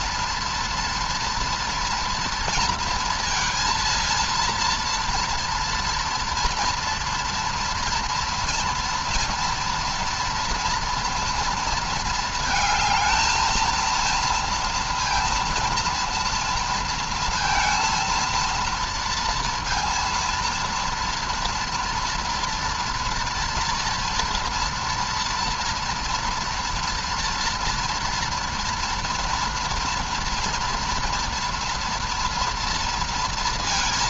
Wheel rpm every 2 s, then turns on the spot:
230, 230, 230, 230, 230, 230, 220, 230, 230, 230, 230, 230, 230, 230, 240, 230, 230.
none